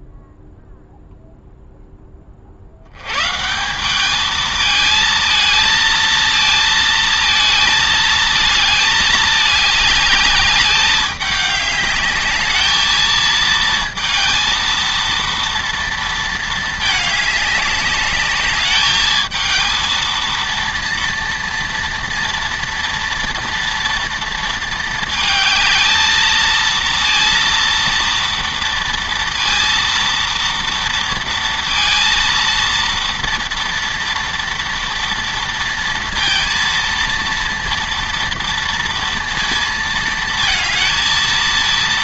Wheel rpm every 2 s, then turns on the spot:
0, 80, 220, 230, 220, 200, 220, 230, 220, 210, 230, 230, 220, 230, 230, 230, 230, 230, 230, 230, 220.
none